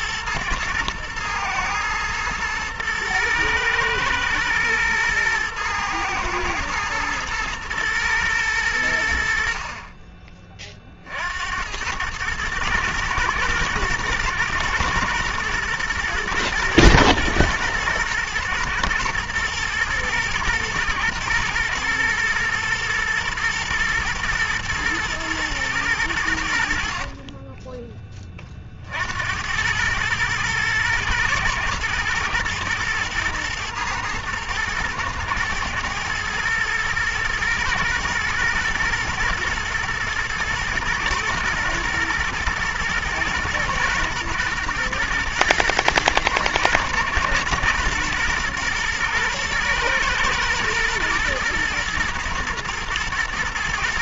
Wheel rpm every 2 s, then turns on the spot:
120, 110, 110, 110, 60, 60, 110, 110, 110, 110, 120, 120, 120, 50, 40, 110, 120, 120, 110, 120, 110, 110, 120, 120, 120, 110, 110.
26-28